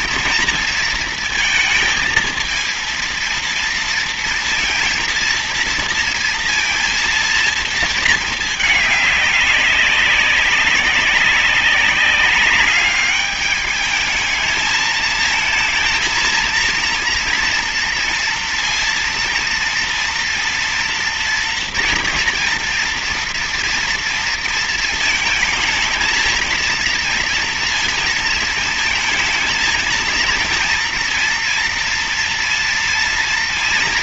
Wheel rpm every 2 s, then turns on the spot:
230, 230, 230, 230, 210, 190, 200, 220, 230, 230, 240, 230, 230, 230, 220, 230, 230.
none